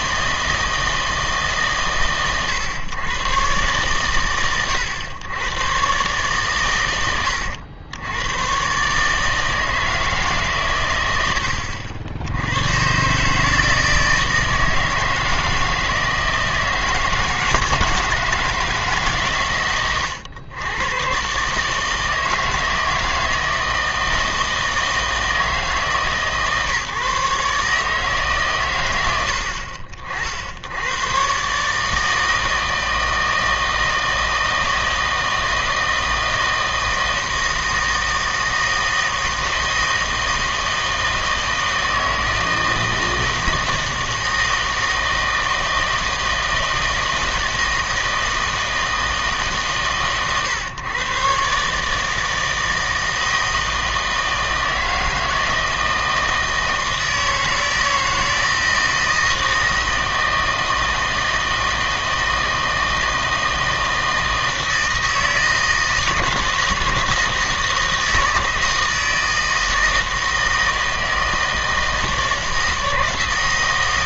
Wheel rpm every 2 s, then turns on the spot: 160, 120, 110, 110, 130, 130, 110, 160, 160, 160, 110, 160, 160, 150, 130, 80, 160, 160, 160, 160, 160, 160, 160, 160, 160, 130, 160, 160, 160, 160, 160, 160, 160, 160, 160, 160, 160.
none